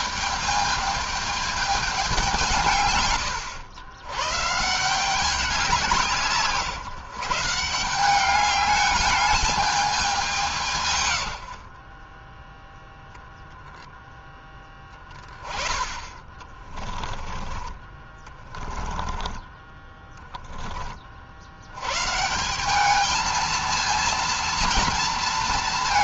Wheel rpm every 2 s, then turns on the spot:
220, 130, 170, 150, 210, 150, 0, 10, 30, 10, 40, 200, 230.
16-20